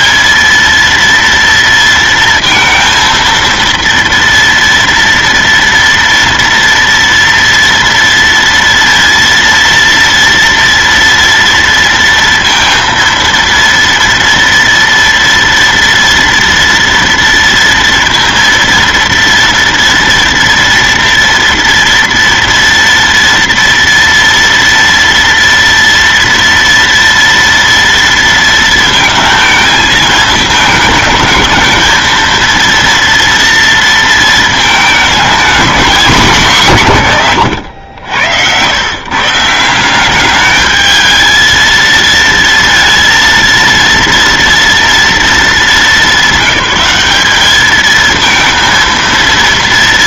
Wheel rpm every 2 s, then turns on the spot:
230, 230, 230, 230, 230, 230, 230, 230, 230, 230, 230, 230, 230, 230, 230, 220, 230, 230, 210, 80, 200, 230, 230, 200, 220.
none